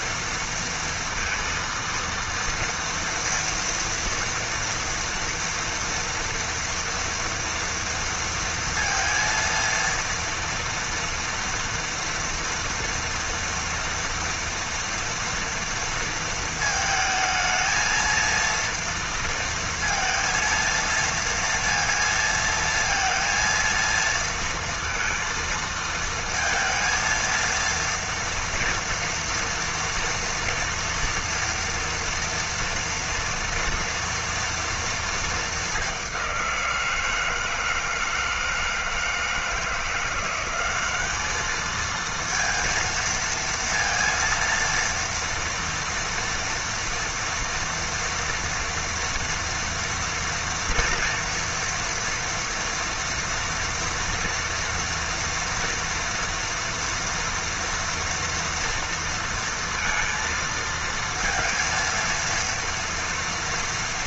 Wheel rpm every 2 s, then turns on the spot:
230, 230, 230, 230, 230, 230, 230, 230, 220, 230, 230, 230, 230, 230, 230, 230, 230, 230, 180, 160, 190, 230, 230, 230, 230, 230, 240, 230, 230, 230, 230, 230.
none